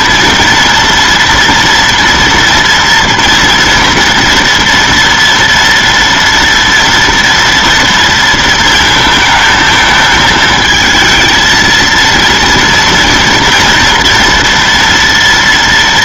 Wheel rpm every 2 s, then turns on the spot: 230, 230, 240, 230, 230, 220, 230, 230.
none